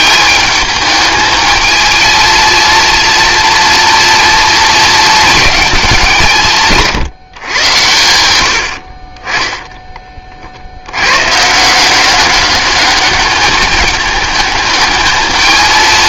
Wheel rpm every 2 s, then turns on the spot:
210, 230, 230, 170, 90, 40, 200, 210.
none